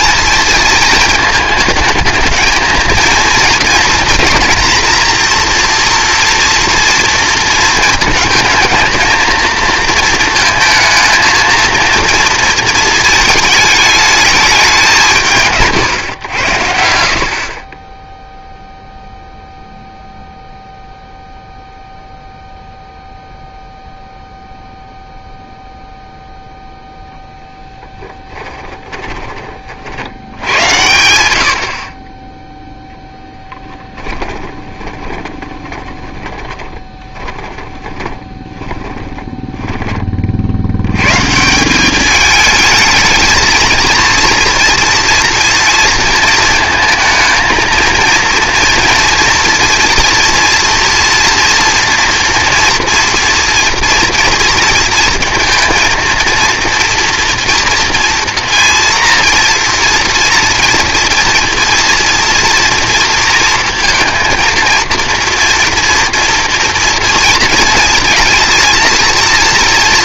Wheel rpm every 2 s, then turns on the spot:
230, 230, 230, 240, 220, 230, 220, 170, 80, 0, 0, 0, 0, 0, 10, 90, 0, 20, 20, 20, 90, 210, 230, 230, 230, 230, 230, 230, 230, 230, 230, 230, 230, 230, 230.
28-30 34-40